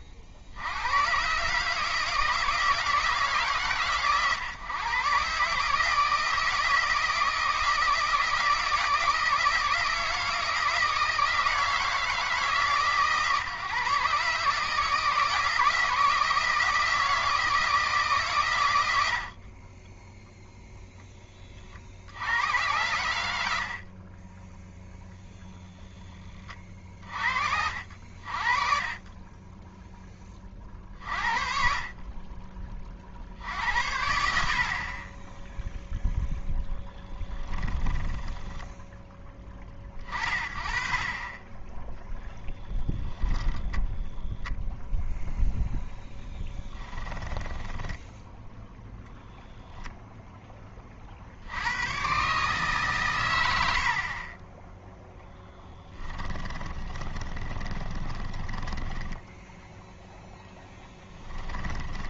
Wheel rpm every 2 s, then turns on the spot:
80, 160, 130, 160, 160, 160, 150, 150, 160, 110, 0, 100, 10, 40, 40, 30, 30, 60, 0, 10, 40, 0, 0, 10, 0, 20, 140, 10, 20, 10, 10.
38-40 46-48 56-62